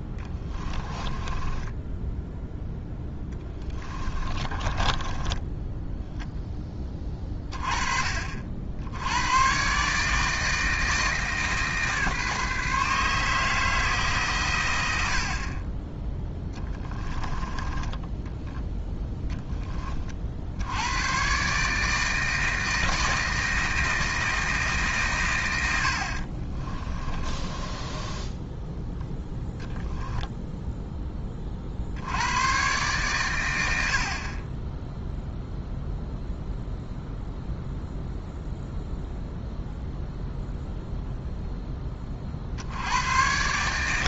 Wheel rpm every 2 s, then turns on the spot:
20, 10, 20, 20, 80, 160, 150, 100, 10, 10, 100, 160, 150, 30, 10, 10, 120, 10, 0, 0, 0, 90.
0-2 4-6 16-18 26-28